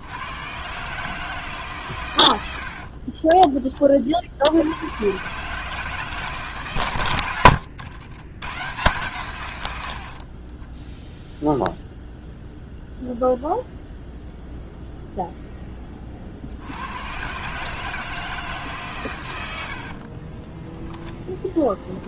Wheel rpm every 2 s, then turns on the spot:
120, 70, 80, 130, 110, 20, 0, 0, 80, 150, 10.
10-12 20-22